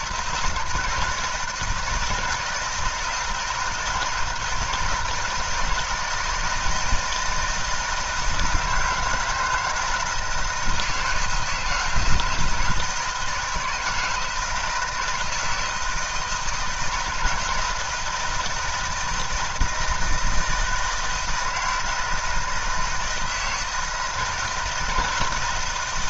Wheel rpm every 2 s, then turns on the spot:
160, 160, 160, 160, 160, 160, 160, 170, 160, 160, 160, 170, 160.
none